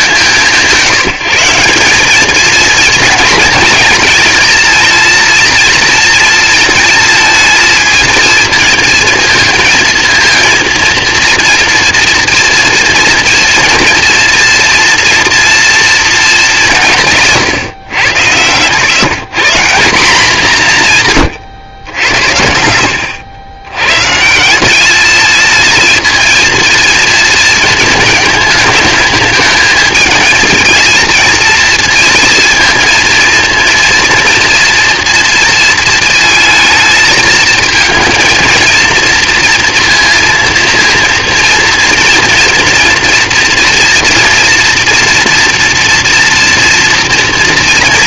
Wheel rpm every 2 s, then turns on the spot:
180, 220, 220, 230, 220, 230, 230, 230, 200, 100, 200, 80, 170, 230, 220, 220, 230, 230, 220, 230, 230, 230, 230, 230.
none